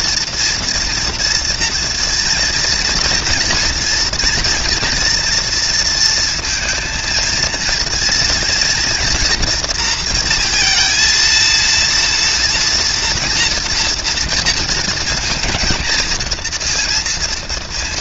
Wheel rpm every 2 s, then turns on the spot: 230, 230, 230, 230, 230, 230, 230, 230, 230.
none